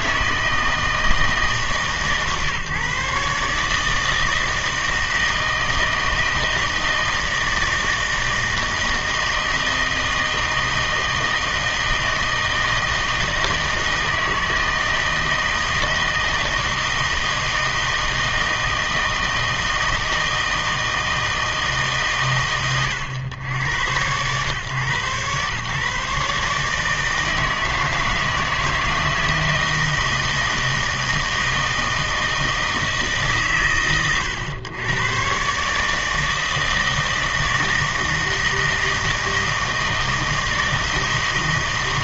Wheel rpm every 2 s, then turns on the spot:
160, 140, 160, 160, 160, 160, 160, 160, 160, 160, 160, 120, 120, 150, 160, 160, 160, 110, 160, 160, 160.
none